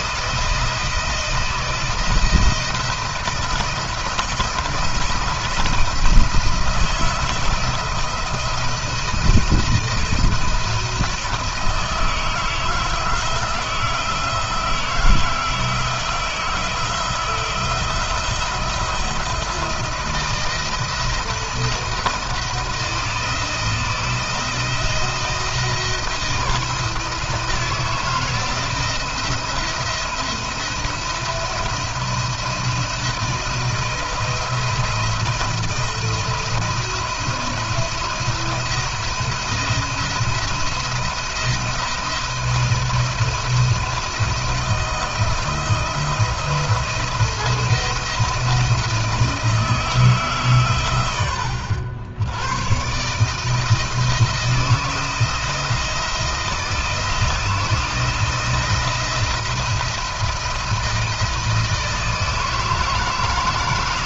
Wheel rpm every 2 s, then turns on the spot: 160, 160, 160, 160, 170, 170, 160, 160, 160, 170, 160, 160, 170, 160, 170, 170, 160, 170, 170, 170, 170, 170, 160, 170, 160, 130, 120, 160, 160, 170, 170, 160.
none